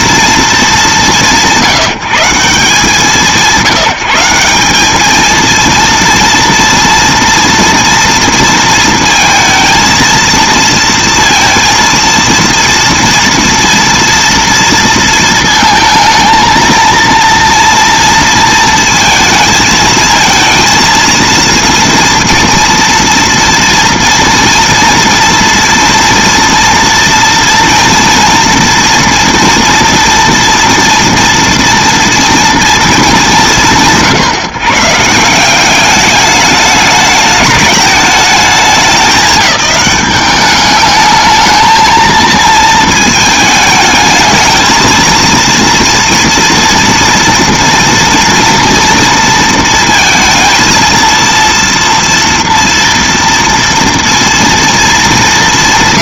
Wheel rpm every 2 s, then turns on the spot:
170, 160, 230, 230, 230, 230, 230, 230, 230, 220, 230, 230, 230, 230, 240, 240, 160, 170, 210, 190, 220, 220, 230, 230, 230, 230, 230, 210.
none